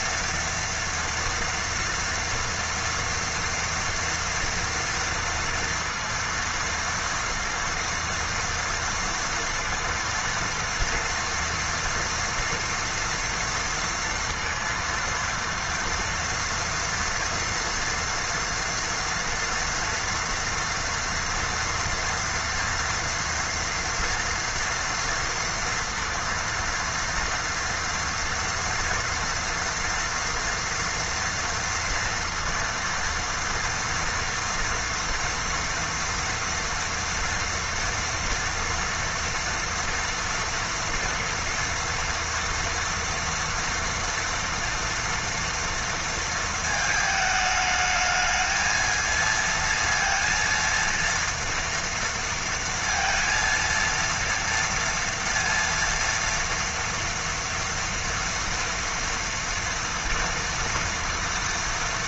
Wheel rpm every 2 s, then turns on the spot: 230, 230, 230, 230, 230, 230, 230, 230, 230, 230, 230, 230, 230, 230, 230, 230, 230, 230, 230, 240, 230, 230, 240, 220, 220, 230, 230, 230, 230, 230, 230.
none